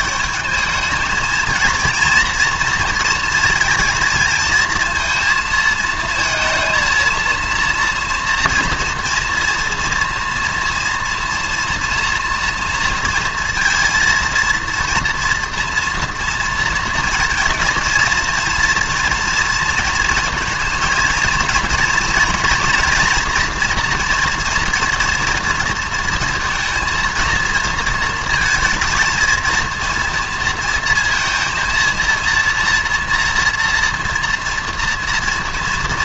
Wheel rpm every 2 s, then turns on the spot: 210, 230, 230, 230, 230, 230, 230, 230, 230, 240, 230, 240, 230, 230, 220, 230, 230, 230.
none